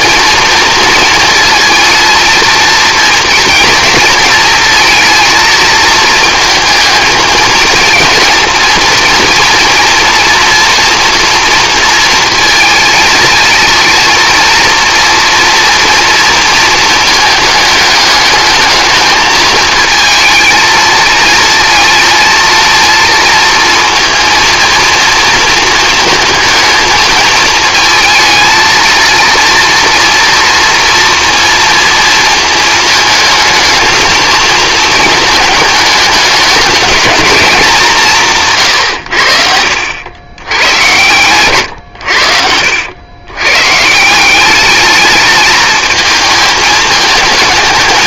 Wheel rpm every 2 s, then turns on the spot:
230, 230, 230, 220, 230, 230, 220, 230, 230, 220, 220, 230, 230, 220, 220, 230, 220, 220, 210, 130, 110, 80, 210, 220.
38-40